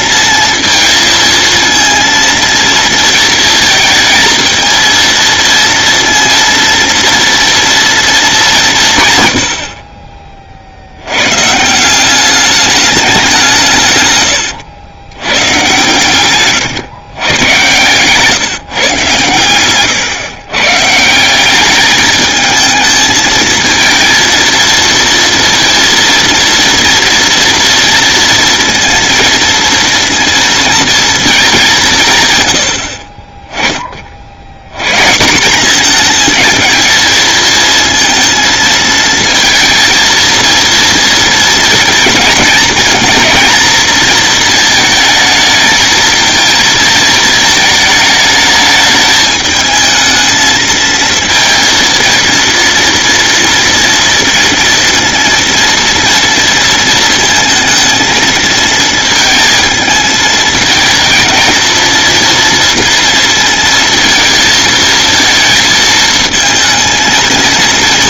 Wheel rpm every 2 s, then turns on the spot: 230, 230, 230, 230, 160, 90, 200, 100, 120, 130, 140, 220, 230, 230, 230, 230, 70, 160, 220, 220, 230, 220, 220, 220, 210, 220, 230, 230, 230, 220, 220, 230, 230, 230.
16-18